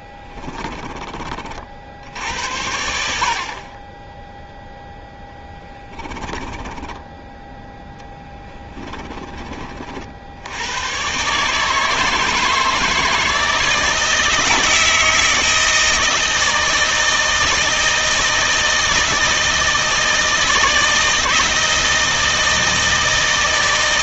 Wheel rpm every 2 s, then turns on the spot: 20, 80, 0, 10, 20, 100, 160, 160, 160, 160, 160, 160.
0-2 6-10